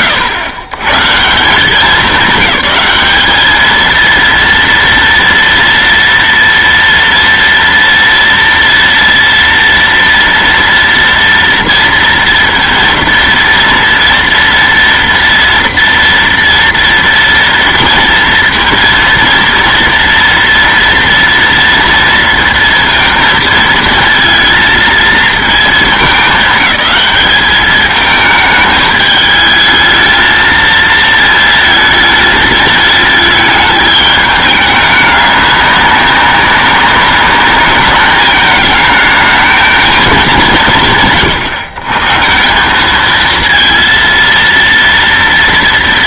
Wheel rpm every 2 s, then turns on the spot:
130, 210, 230, 230, 230, 230, 230, 230, 230, 230, 230, 230, 220, 210, 210, 230, 220, 210, 200, 220, 120, 200, 230.
none